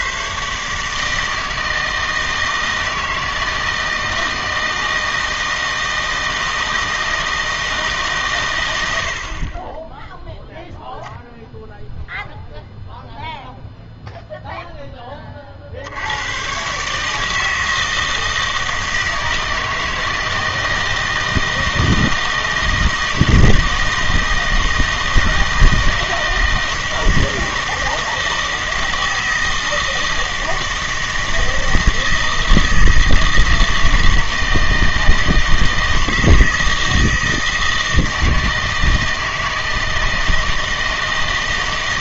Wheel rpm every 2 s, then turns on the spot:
150, 160, 160, 160, 110, 0, 0, 0, 120, 160, 160, 160, 160, 160, 160, 160, 160, 160, 160, 160, 160.
none